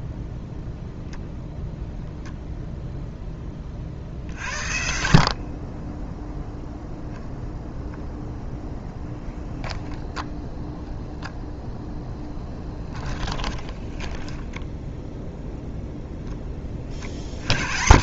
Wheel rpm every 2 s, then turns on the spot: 0, 0, 50, 0, 0, 0, 10, 10, 30.
12-16